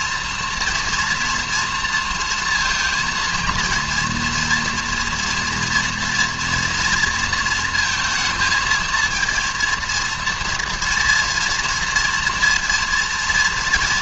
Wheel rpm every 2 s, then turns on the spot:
240, 230, 240, 230, 220, 230, 230.
none